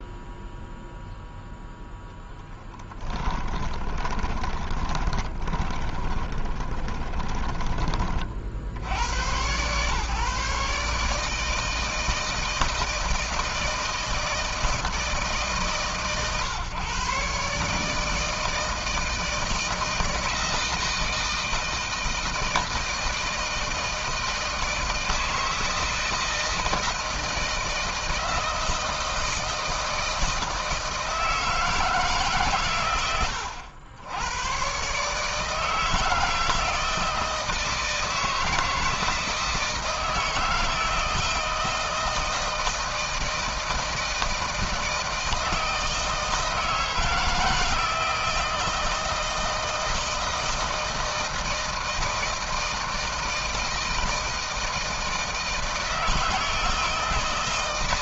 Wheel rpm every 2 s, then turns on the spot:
0, 10, 20, 20, 60, 150, 160, 160, 140, 160, 160, 160, 160, 160, 160, 160, 130, 110, 160, 160, 160, 160, 160, 160, 160, 160, 160, 160, 160.
2-8